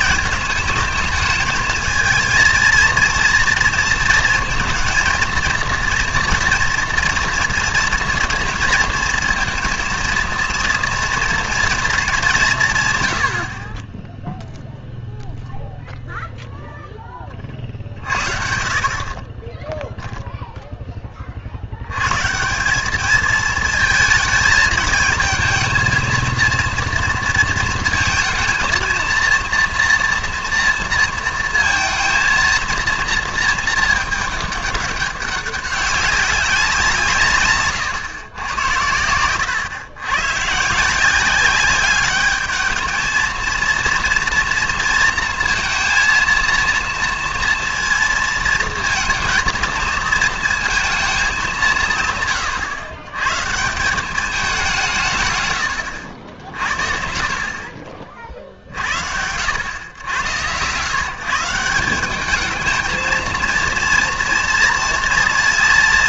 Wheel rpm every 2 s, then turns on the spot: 220, 230, 230, 230, 230, 230, 160, 0, 0, 50, 0, 180, 220, 230, 220, 230, 230, 200, 180, 100, 140, 220, 230, 230, 230, 220, 120, 190, 60, 50, 120, 220, 230.
none